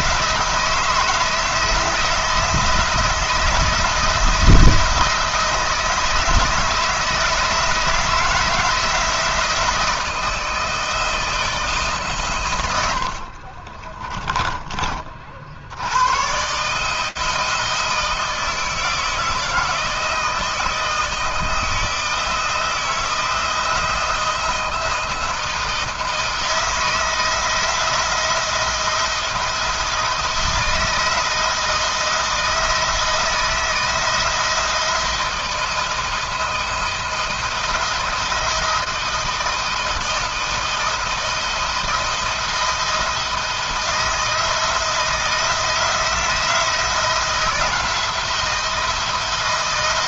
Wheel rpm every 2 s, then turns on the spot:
160, 160, 160, 160, 170, 160, 100, 30, 140, 160, 160, 160, 170, 160, 170, 160, 160, 160, 170, 160, 170, 170, 160, 160, 170.
12-14